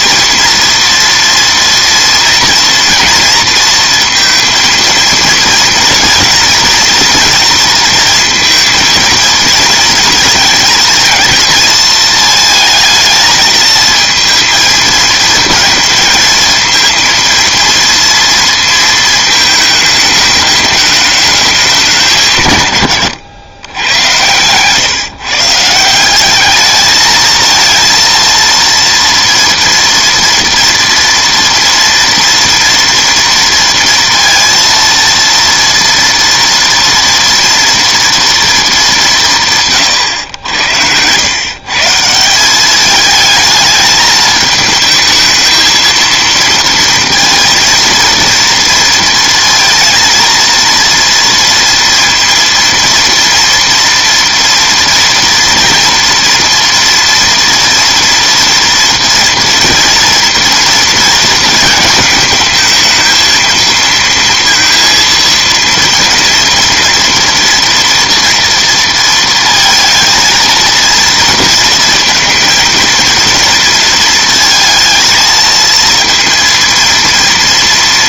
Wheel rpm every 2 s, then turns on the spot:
230, 230, 230, 230, 230, 220, 220, 230, 230, 230, 210, 130, 130, 210, 230, 230, 230, 230, 230, 230, 100, 190, 220, 230, 230, 230, 230, 230, 240, 230, 230, 220, 230, 230, 230, 230, 230, 230, 230.
none